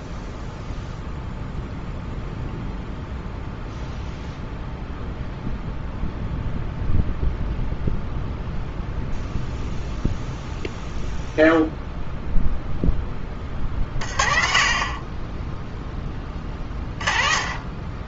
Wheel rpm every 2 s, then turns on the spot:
0, 0, 0, 0, 0, 0, 0, 30, 20.
none